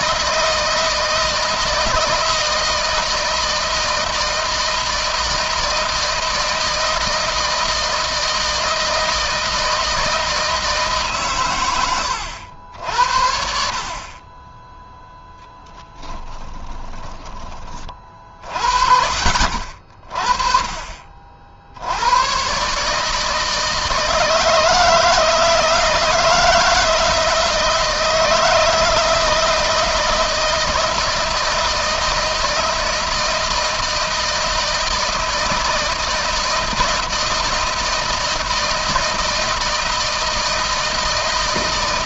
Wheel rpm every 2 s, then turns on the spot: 160, 160, 160, 160, 160, 160, 80, 20, 10, 40, 40, 110, 160, 160, 160, 160, 160, 160, 160, 160, 160.
16-18